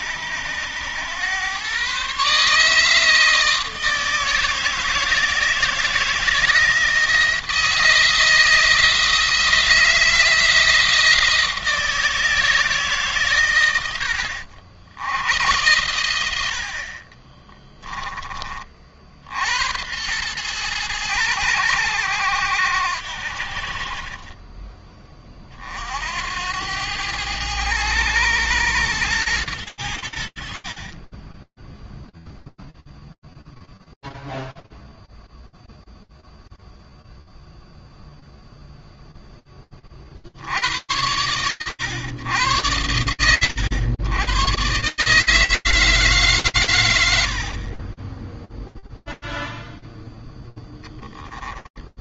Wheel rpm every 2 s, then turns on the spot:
110, 160, 160, 170, 170, 170, 140, 80, 50, 50, 110, 80, 30, 100, 120, 40, 0, 0, 0, 10, 110, 100, 160, 90, 0, 10.
16-18 30-32 50-52